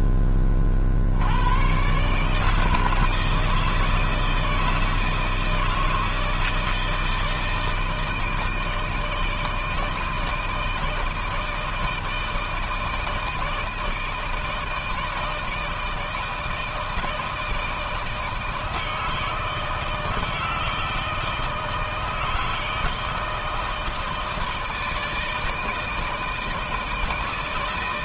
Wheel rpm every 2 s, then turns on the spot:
70, 160, 160, 160, 160, 160, 160, 160, 160, 160, 160, 160, 160, 160.
none